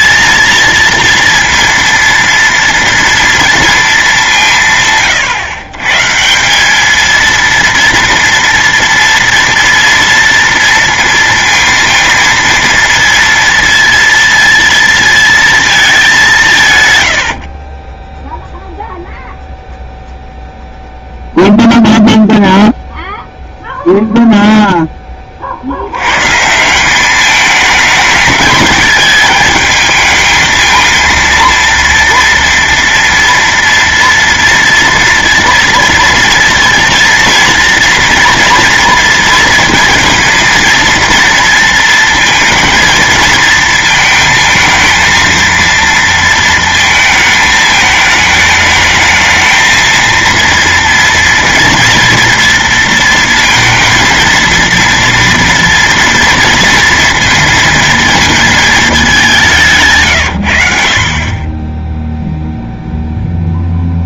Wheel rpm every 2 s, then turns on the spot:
230, 230, 170, 200, 230, 230, 230, 230, 150, 0, 0, 0, 0, 180, 220, 230, 240, 230, 230, 230, 230, 230, 220, 230, 220, 230, 230, 230, 230, 220, 80, 0.
none